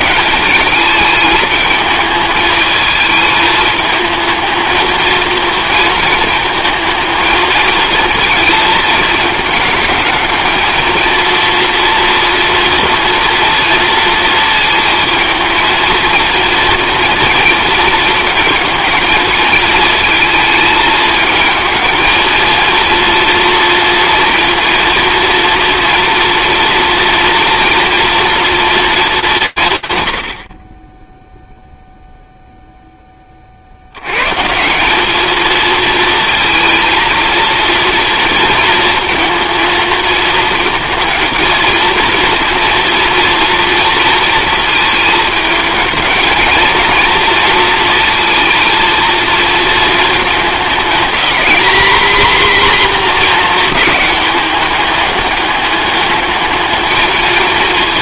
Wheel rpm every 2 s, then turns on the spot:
210, 220, 220, 220, 220, 220, 230, 220, 230, 220, 220, 230, 230, 230, 220, 20, 0, 180, 230, 230, 220, 230, 220, 220, 230, 220, 250, 200, 220.
none